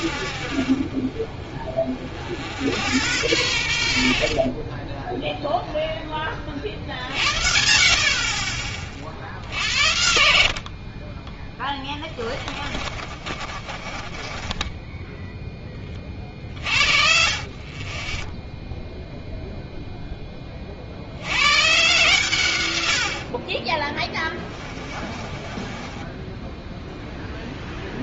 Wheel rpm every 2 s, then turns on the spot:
50, 70, 40, 40, 40, 60, 30, 20, 40, 0, 30, 110, 20, 10.
4-6 12-16 24-28